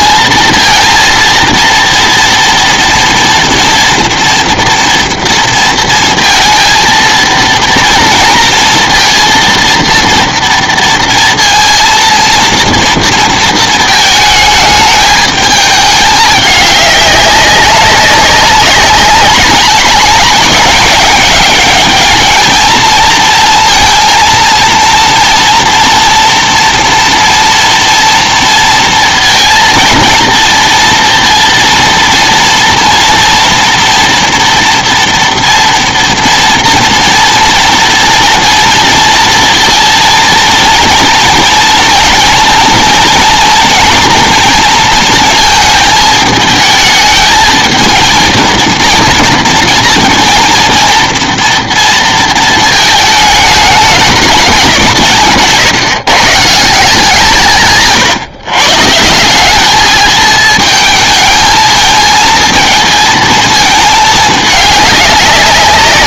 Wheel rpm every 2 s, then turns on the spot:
220, 230, 240, 230, 230, 230, 230, 210, 200, 200, 200, 220, 230, 230, 230, 230, 230, 230, 230, 230, 230, 240, 230, 220, 230, 230, 220, 190, 170, 140, 220, 230, 210.
none